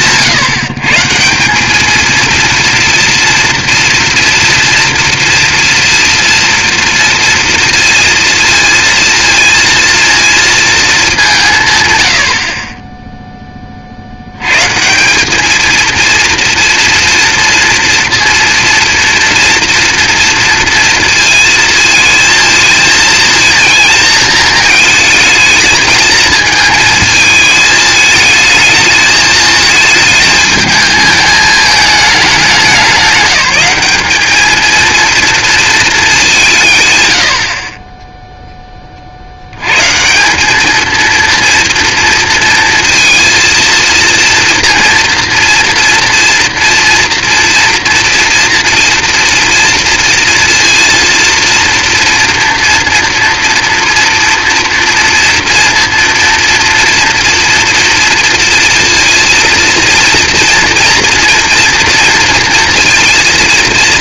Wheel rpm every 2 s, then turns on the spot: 150, 230, 230, 230, 230, 230, 60, 110, 230, 230, 230, 220, 220, 220, 220, 220, 200, 210, 170, 10, 200, 230, 230, 230, 240, 230, 230, 230, 240, 230, 230, 230.
none